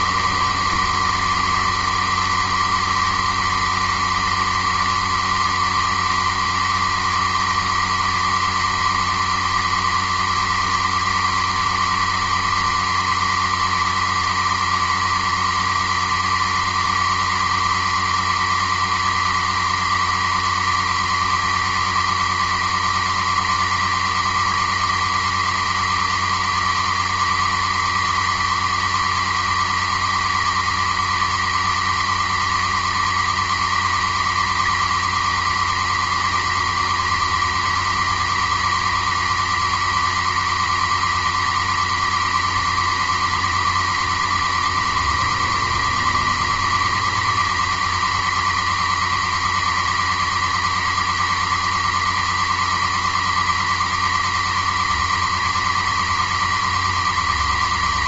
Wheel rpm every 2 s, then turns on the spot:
140, 140, 140, 130, 140, 140, 140, 140, 140, 140, 140, 140, 140, 140, 140, 140, 130, 140, 140, 130, 140, 140, 140, 140, 140, 140, 130, 140, 130.
none